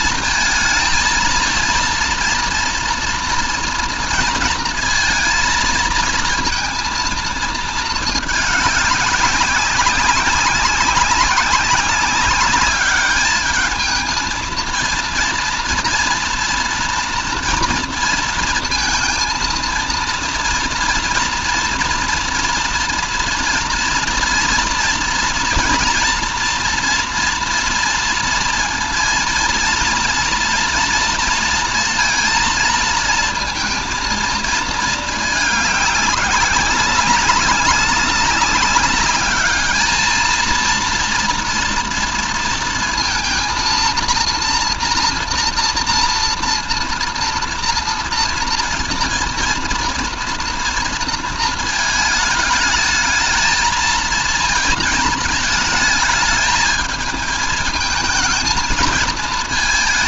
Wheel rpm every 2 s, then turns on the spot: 220, 230, 220, 230, 210, 190, 200, 230, 230, 230, 230, 230, 230, 230, 230, 230, 230, 220, 200, 200, 230, 230, 230, 230, 230, 230, 220, 220, 220, 220.
none